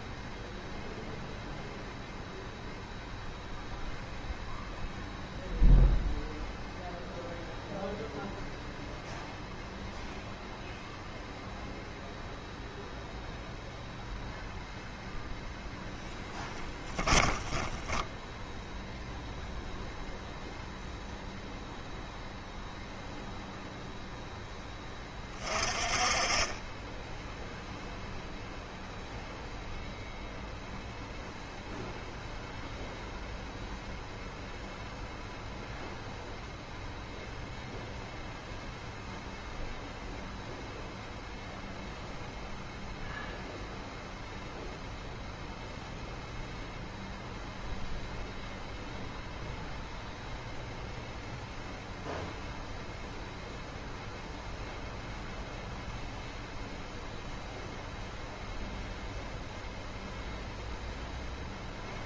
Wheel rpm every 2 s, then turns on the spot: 0, 0, 0, 0, 0, 0, 0, 0, 10, 0, 0, 0, 10, 10, 0, 0, 0, 0, 0, 0, 0, 0, 0, 0, 0, 0, 0, 0, 0, 0, 0.
16-18